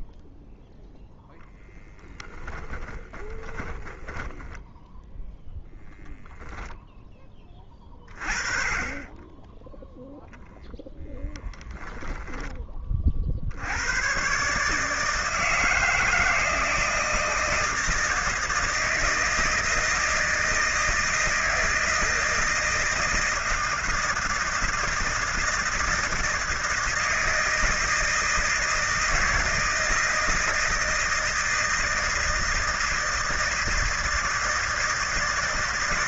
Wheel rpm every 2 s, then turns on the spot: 0, 20, 10, 10, 20, 0, 20, 150, 160, 160, 160, 160, 160, 160, 160, 160, 160, 160.
2-6